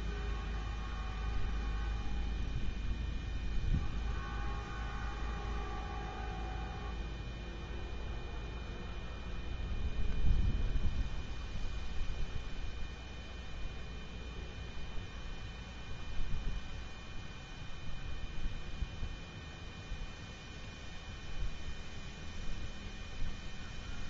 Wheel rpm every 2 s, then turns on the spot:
0, 0, 0, 0, 0, 0, 0, 0, 0, 0, 0, 0.
none